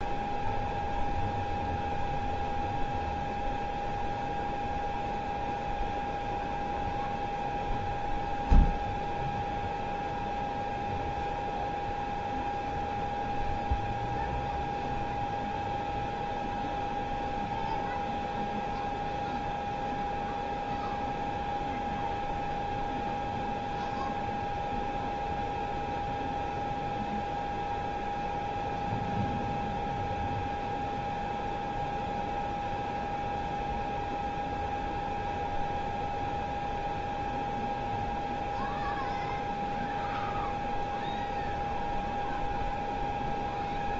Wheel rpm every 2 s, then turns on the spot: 0, 0, 0, 0, 0, 0, 0, 0, 0, 0, 0, 0, 0, 0, 0, 0, 0, 0, 0, 0, 0, 0.
none